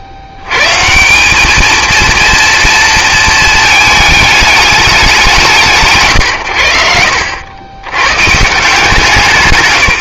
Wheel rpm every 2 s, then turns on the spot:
80, 230, 220, 110, 150.
none